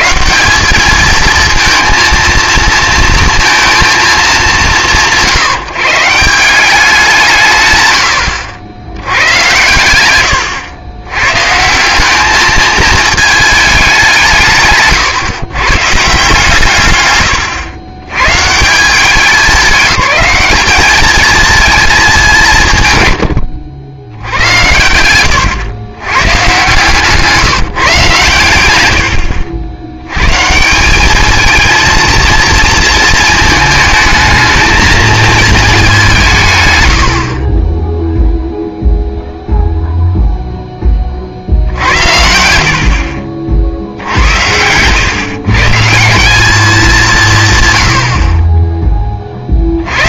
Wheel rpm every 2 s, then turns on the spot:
190, 230, 140, 190, 90, 90, 220, 150, 130, 160, 210, 130, 90, 140, 90, 180, 230, 230, 130, 0, 10, 70, 110, 210, 20.
14-16 26-30